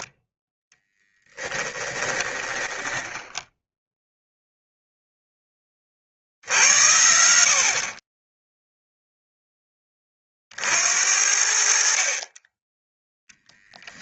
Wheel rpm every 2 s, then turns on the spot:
10, 10, 0, 90, 0, 70, 10.
0-4